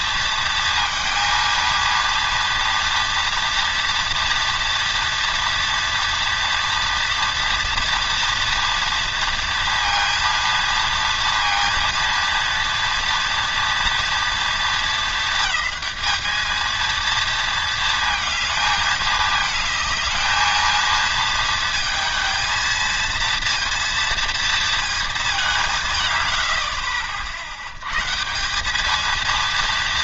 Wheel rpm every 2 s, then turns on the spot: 230, 230, 230, 230, 230, 230, 230, 230, 220, 220, 230, 230, 230, 80, 180.
26-28